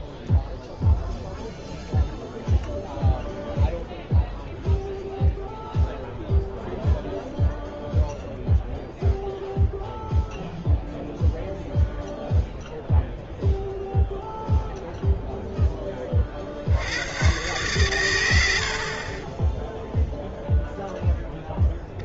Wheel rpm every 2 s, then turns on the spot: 0, 0, 0, 0, 0, 0, 0, 0, 70, 70, 0.
none